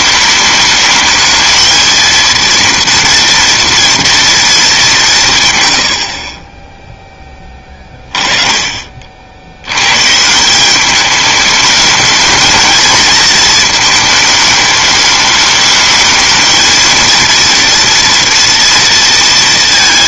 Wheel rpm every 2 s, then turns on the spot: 210, 230, 210, 20, 30, 180, 220, 210, 220, 230.
none